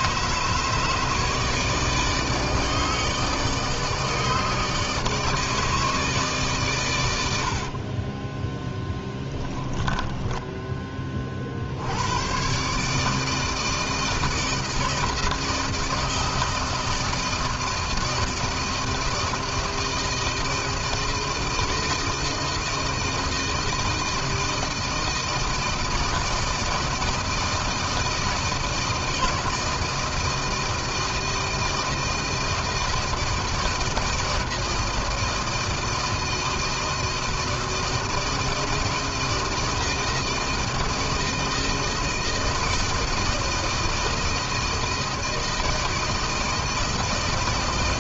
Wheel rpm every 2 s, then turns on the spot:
150, 150, 150, 100, 10, 30, 150, 160, 160, 160, 160, 170, 160, 160, 160, 160, 160, 160, 160, 160, 160, 160, 160, 160.
8-10